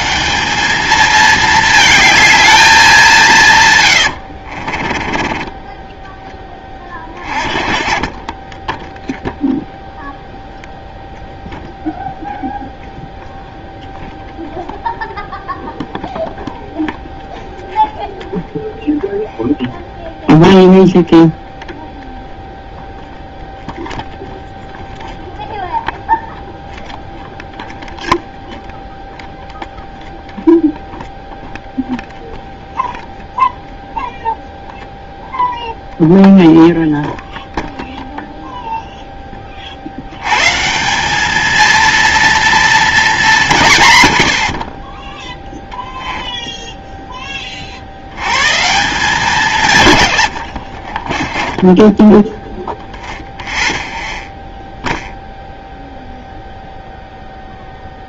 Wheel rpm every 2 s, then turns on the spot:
200, 210, 60, 20, 10, 0, 0, 0, 0, 0, 0, 0, 0, 0, 0, 0, 0, 0, 0, 0, 160, 230, 50, 10, 150, 70, 0, 0, 0.
4-6 50-52